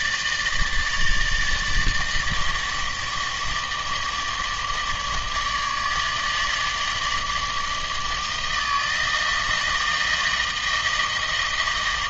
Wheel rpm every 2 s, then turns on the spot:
150, 160, 150, 150, 160, 160.
none